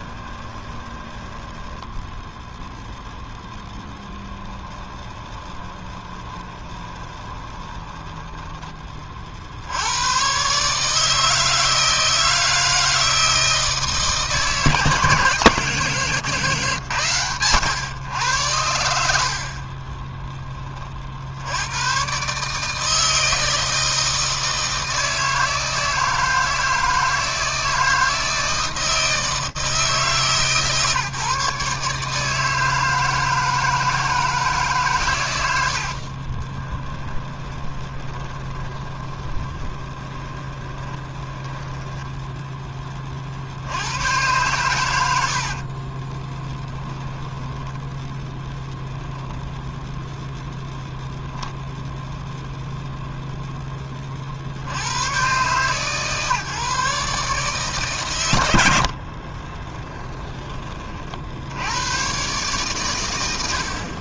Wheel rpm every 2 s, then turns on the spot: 20, 10, 20, 20, 20, 140, 160, 160, 130, 90, 30, 150, 160, 160, 160, 150, 160, 150, 20, 20, 20, 20, 100, 10, 0, 0, 0, 110, 150, 60, 30, 130.
0-2 4-8 36-42 46-48 58-60